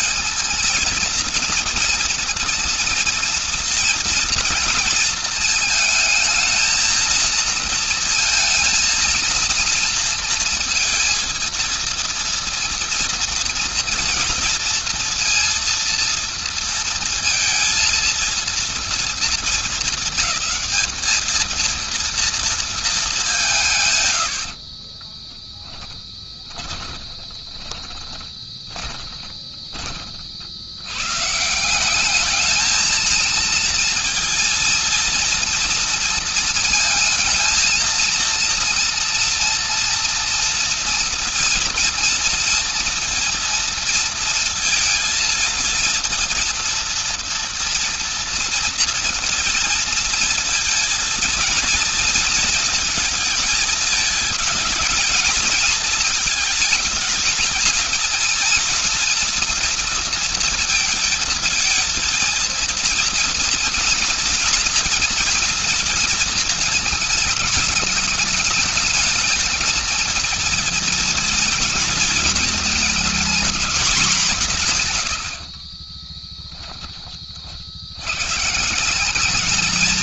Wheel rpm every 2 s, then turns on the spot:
220, 230, 230, 220, 230, 230, 230, 240, 230, 230, 210, 230, 100, 10, 20, 50, 210, 230, 230, 230, 230, 230, 230, 230, 230, 230, 230, 220, 220, 230, 230, 230, 240, 230, 220, 220, 230, 190, 20, 110.
24-30 76-78